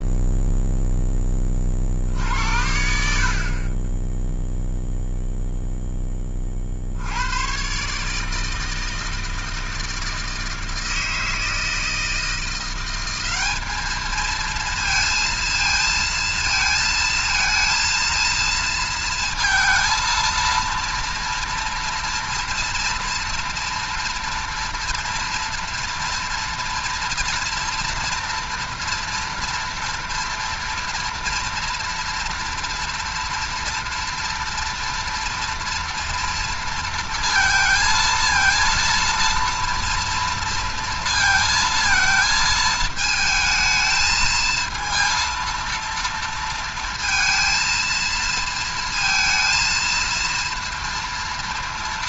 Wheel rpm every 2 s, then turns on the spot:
0, 60, 0, 50, 160, 160, 180, 230, 220, 230, 230, 230, 230, 230, 230, 230, 230, 230, 230, 230, 230, 220, 220, 230, 230, 230.
none